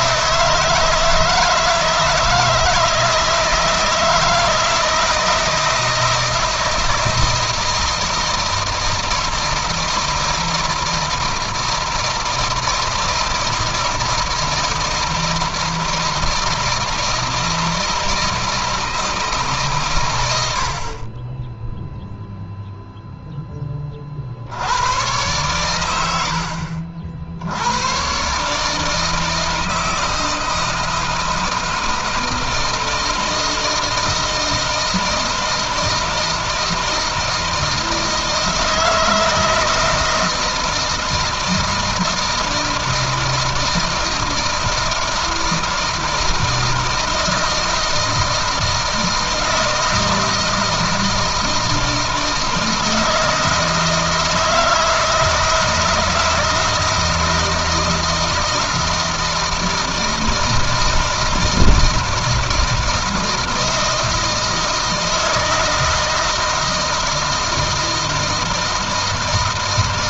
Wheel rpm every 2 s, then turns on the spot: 160, 160, 160, 160, 160, 160, 160, 170, 160, 160, 40, 0, 90, 60, 160, 160, 160, 160, 160, 160, 160, 160, 160, 160, 160, 160, 160, 160, 160, 160, 160, 160, 160, 160, 160.
none